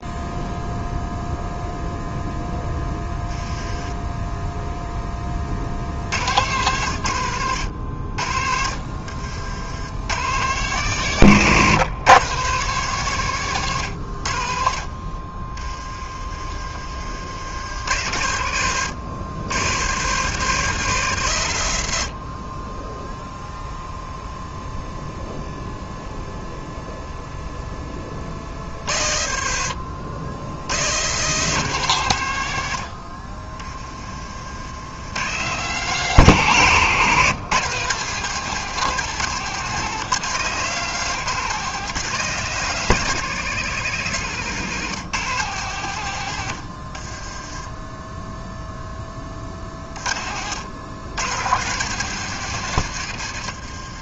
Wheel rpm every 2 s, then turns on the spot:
0, 10, 20, 100, 60, 130, 130, 40, 50, 100, 120, 0, 0, 0, 40, 100, 60, 100, 130, 160, 150, 150, 140, 40, 20, 100, 110.
46-48